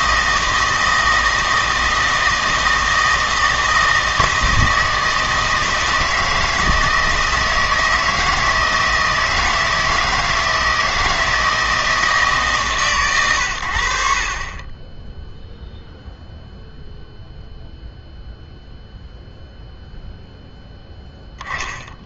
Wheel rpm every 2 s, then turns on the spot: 160, 160, 160, 160, 160, 160, 130, 20, 0, 0, 0.
none